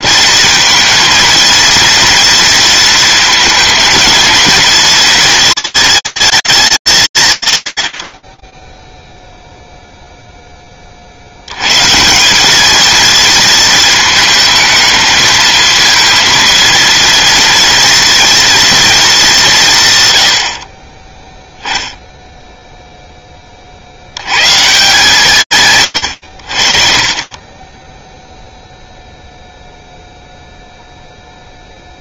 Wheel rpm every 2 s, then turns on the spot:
230, 230, 230, 220, 40, 10, 200, 220, 230, 230, 40, 10, 150, 40, 0, 0.
26-28